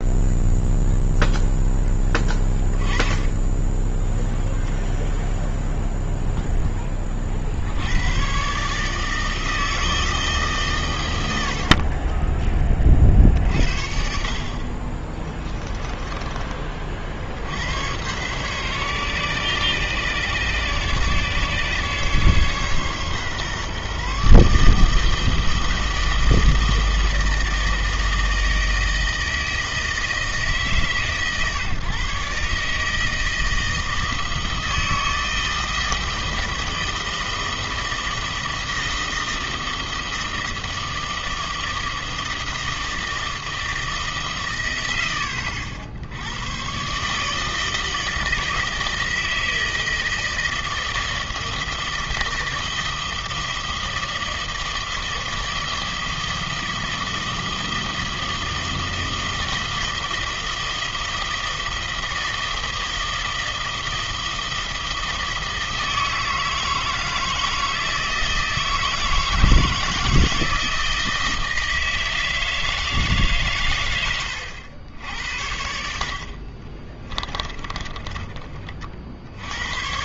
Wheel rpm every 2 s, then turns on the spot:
0, 20, 0, 10, 140, 130, 20, 40, 30, 130, 140, 140, 150, 160, 160, 150, 150, 160, 160, 160, 160, 160, 120, 110, 160, 160, 160, 160, 160, 160, 160, 160, 160, 160, 160, 170, 160, 90, 40, 30.
none